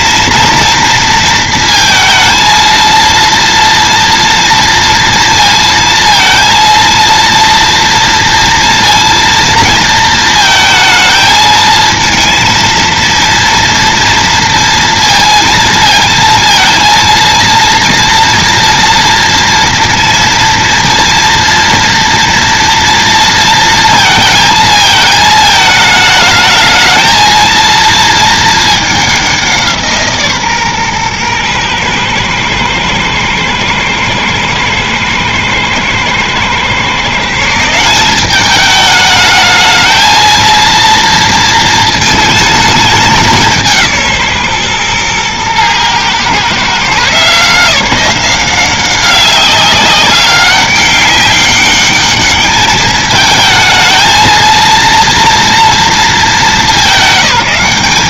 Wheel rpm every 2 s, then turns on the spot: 230, 230, 230, 230, 230, 220, 230, 230, 230, 230, 230, 240, 220, 220, 220, 140, 110, 110, 120, 200, 230, 220, 130, 140, 190, 200, 210, 230, 200.
none